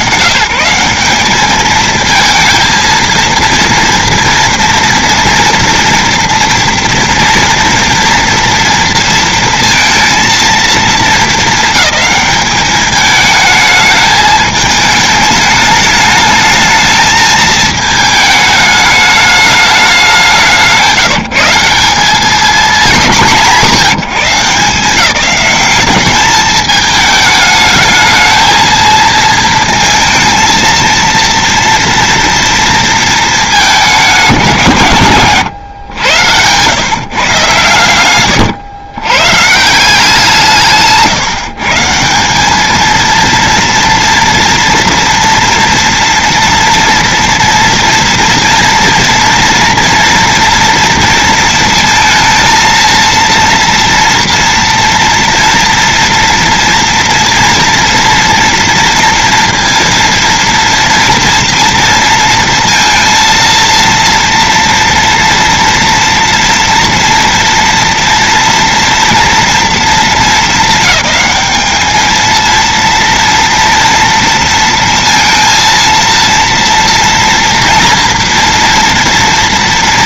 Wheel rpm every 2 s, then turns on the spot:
140, 220, 230, 230, 230, 230, 210, 210, 210, 220, 190, 190, 160, 210, 220, 230, 230, 200, 110, 110, 170, 170, 240, 240, 230, 230, 230, 230, 230, 230, 230, 230, 230, 230, 230, 230, 220, 230, 230, 230.
38-40